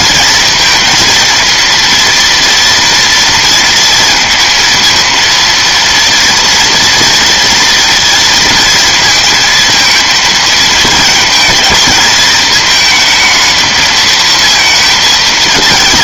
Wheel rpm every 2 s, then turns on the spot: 230, 230, 230, 230, 230, 220, 220, 230.
none